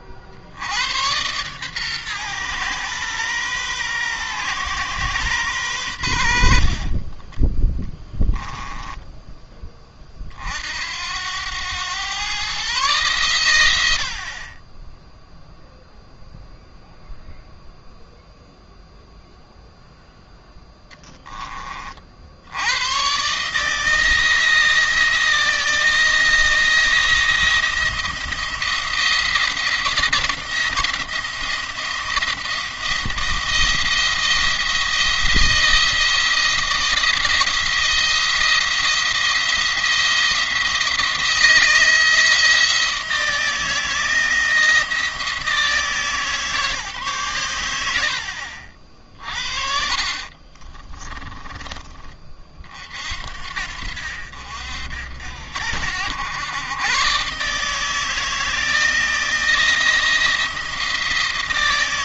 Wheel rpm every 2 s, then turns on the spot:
90, 120, 120, 50, 10, 60, 130, 30, 0, 0, 10, 90, 160, 170, 170, 170, 170, 170, 170, 170, 170, 160, 160, 150, 50, 30, 40, 60, 110, 160, 170.
6-10 20-22 48-52